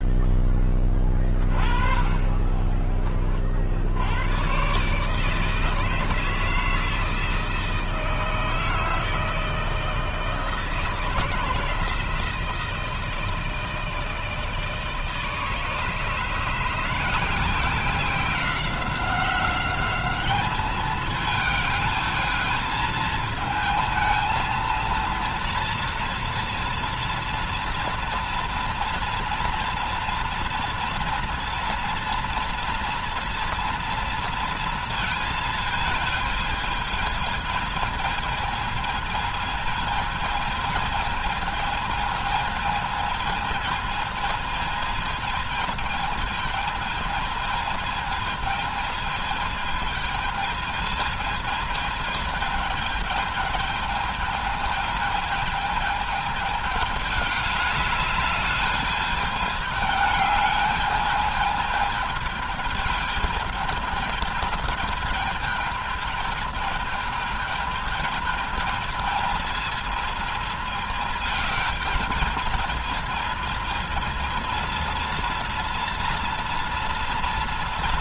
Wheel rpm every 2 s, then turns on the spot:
10, 30, 120, 160, 160, 160, 160, 160, 160, 190, 210, 220, 230, 230, 230, 240, 230, 230, 220, 220, 220, 220, 220, 220, 220, 220, 220, 210, 210, 210, 210, 210, 210, 220, 220, 220, 210, 230, 230.
2-4